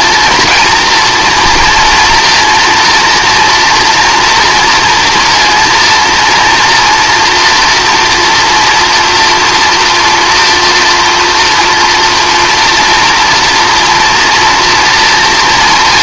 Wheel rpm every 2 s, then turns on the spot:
230, 230, 230, 230, 240, 230, 230, 230.
none